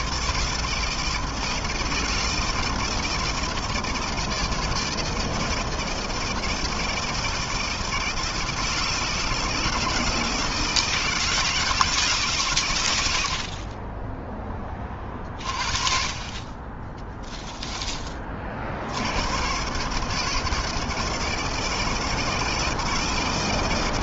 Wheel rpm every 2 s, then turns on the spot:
170, 170, 160, 160, 160, 160, 70, 30, 10, 110, 160, 160.
12-14 16-18